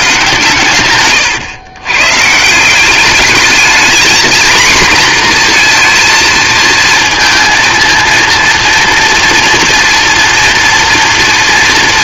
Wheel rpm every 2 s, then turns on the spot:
130, 180, 240, 230, 230, 230.
none